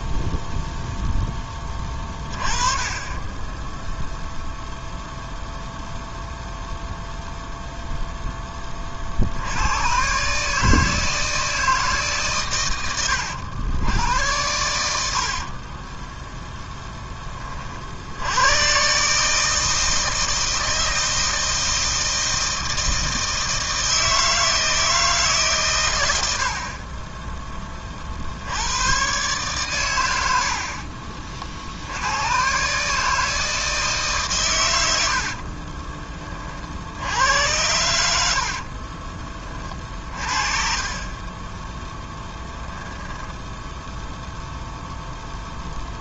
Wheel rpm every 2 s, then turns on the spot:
0, 20, 0, 0, 40, 160, 100, 80, 10, 140, 160, 160, 160, 30, 120, 50, 150, 80, 70, 40, 20, 10, 0.
12-14 26-28 30-32 34-36 38-42